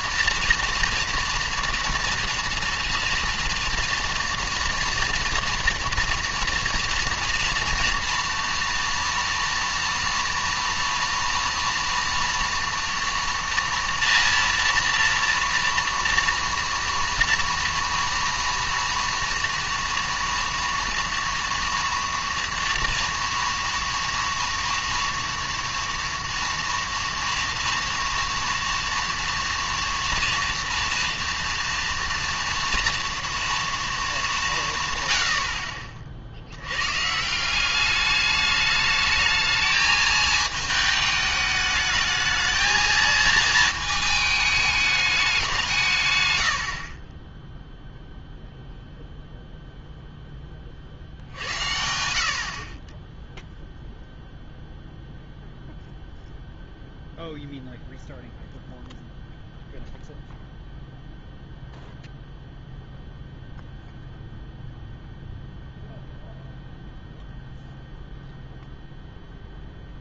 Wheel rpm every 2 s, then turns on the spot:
240, 230, 240, 240, 230, 230, 230, 230, 230, 230, 230, 230, 230, 230, 230, 230, 230, 170, 100, 210, 220, 220, 210, 60, 0, 60, 50, 0, 0, 0, 0, 0, 0, 0, 0.
none